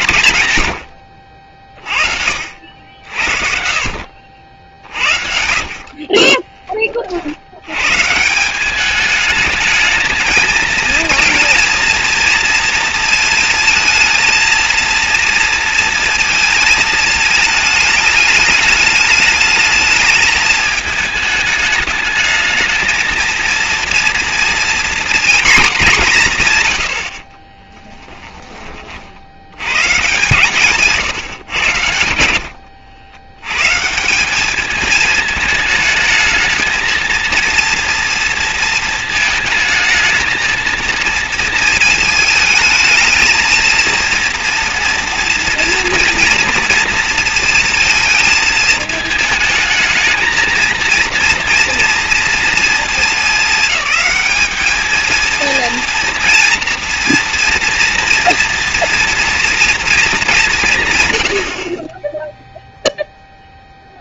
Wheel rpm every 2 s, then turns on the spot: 90, 60, 60, 10, 180, 220, 230, 230, 220, 210, 220, 220, 240, 150, 20, 140, 80, 210, 220, 230, 220, 220, 240, 230, 220, 220, 220, 210, 230, 230, 170, 0.
2-4 32-34